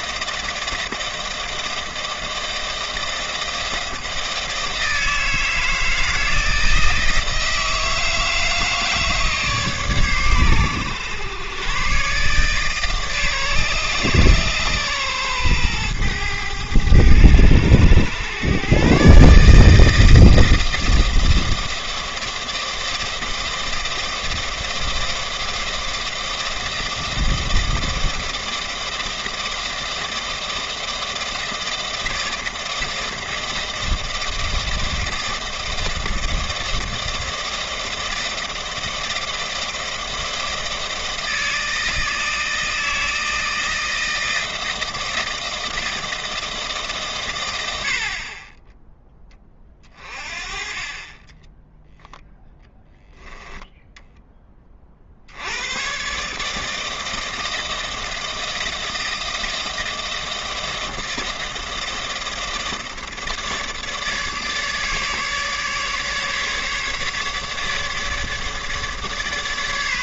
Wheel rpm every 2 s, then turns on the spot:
160, 160, 160, 160, 160, 120, 150, 130, 110, 130, 160, 160, 160, 160, 160, 160, 160, 160, 160, 160, 160, 160, 160, 160, 30, 30, 10, 30, 160, 160, 160, 160, 150, 150, 150.
none